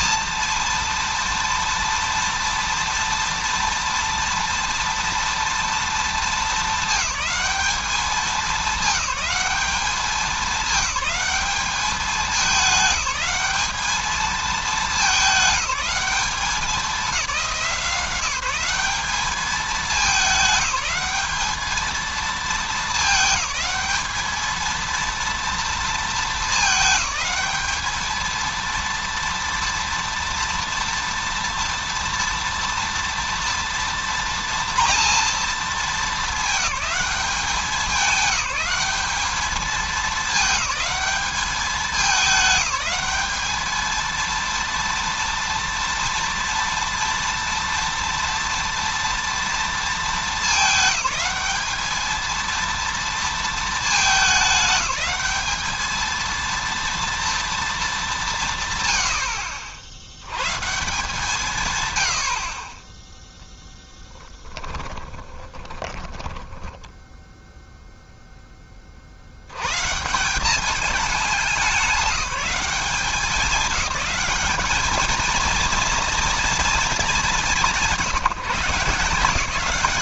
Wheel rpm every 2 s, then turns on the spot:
230, 230, 230, 200, 210, 210, 200, 210, 200, 180, 210, 220, 220, 220, 230, 240, 240, 230, 200, 210, 220, 200, 230, 240, 230, 210, 220, 210, 230, 130, 140, 40, 10, 10, 10, 190, 200, 200, 230, 160.
64-68